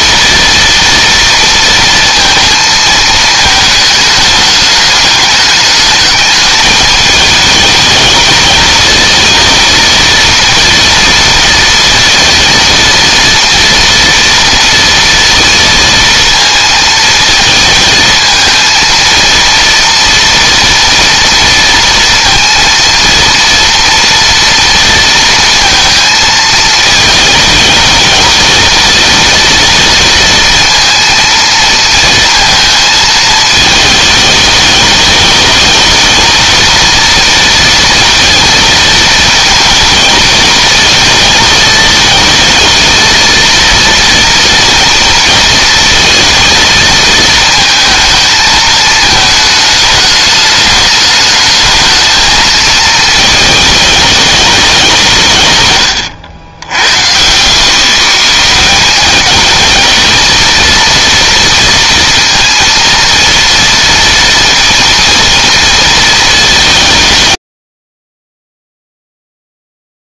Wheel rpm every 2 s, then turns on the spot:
230, 220, 210, 210, 220, 230, 230, 230, 230, 230, 230, 230, 230, 220, 220, 230, 220, 210, 230, 220, 220, 230, 230, 220, 220, 210, 220, 160, 110, 190, 230, 230, 230, 140, 0.
none